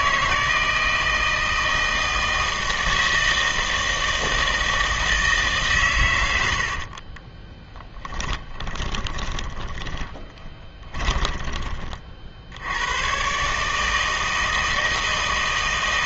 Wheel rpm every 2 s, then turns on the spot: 160, 160, 160, 60, 20, 20, 90, 160.
6-12